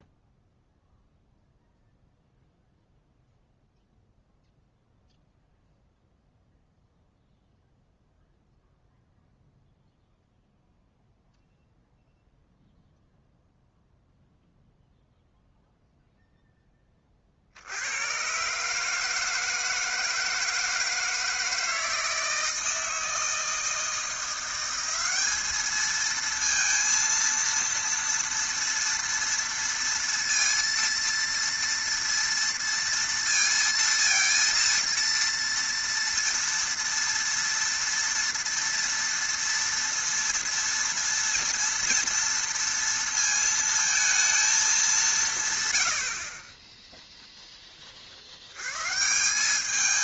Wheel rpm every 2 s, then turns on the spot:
0, 0, 0, 0, 0, 0, 0, 0, 10, 130, 160, 160, 180, 230, 230, 230, 230, 230, 230, 230, 230, 230, 210, 20, 100.
none